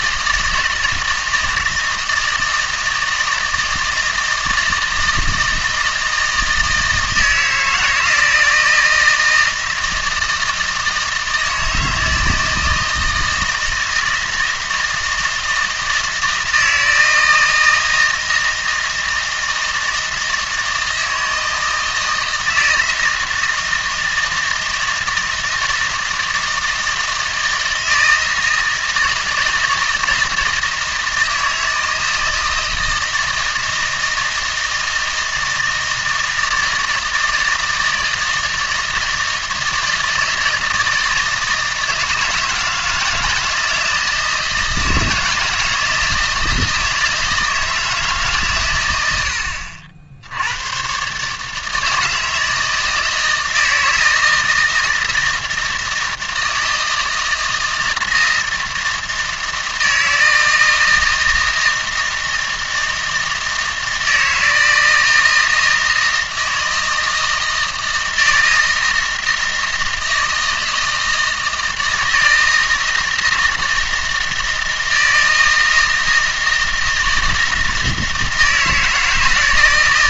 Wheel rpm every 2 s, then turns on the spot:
160, 160, 160, 160, 160, 160, 160, 160, 160, 160, 160, 160, 160, 160, 160, 160, 160, 160, 160, 160, 160, 160, 160, 160, 110, 120, 160, 160, 160, 160, 160, 160, 160, 160, 160, 160, 160, 160, 160, 160.
none